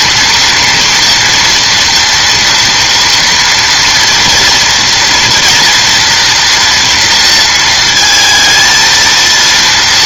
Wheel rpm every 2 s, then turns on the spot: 240, 230, 240, 230, 230.
none